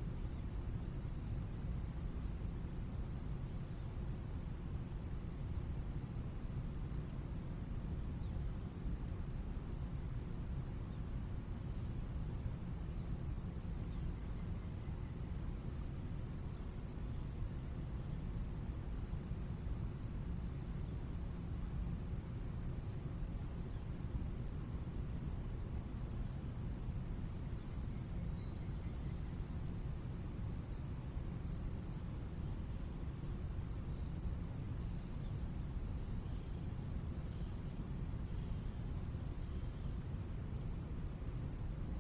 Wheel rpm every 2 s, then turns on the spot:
0, 0, 0, 0, 0, 0, 0, 0, 0, 0, 0, 0, 0, 0, 0, 0, 0, 0, 0, 0, 0.
none